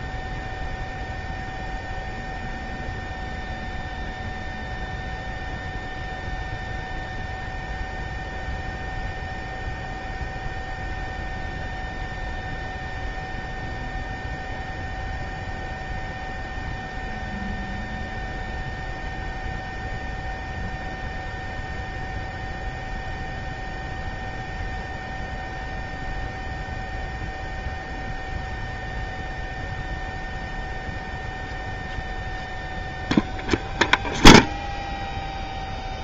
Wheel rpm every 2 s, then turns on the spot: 0, 0, 0, 0, 0, 0, 0, 0, 0, 0, 0, 0, 0, 0, 0, 0, 0, 0.
none